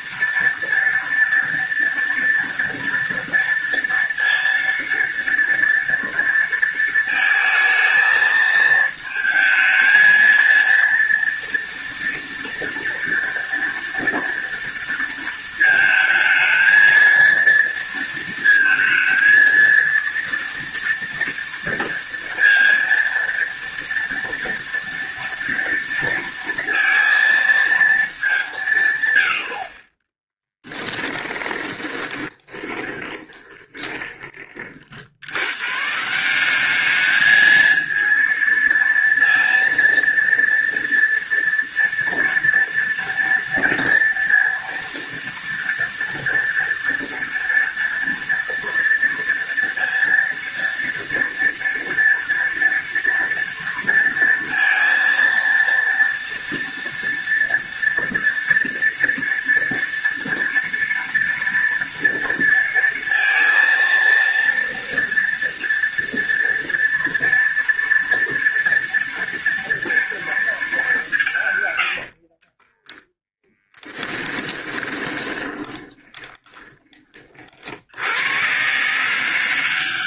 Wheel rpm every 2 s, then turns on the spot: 230, 230, 230, 230, 220, 230, 230, 230, 220, 230, 230, 230, 230, 230, 190, 20, 20, 40, 190, 230, 230, 230, 230, 230, 230, 230, 230, 230, 230, 230, 230, 230, 230, 230, 230, 220, 50, 20, 30, 100.
30-34 72-78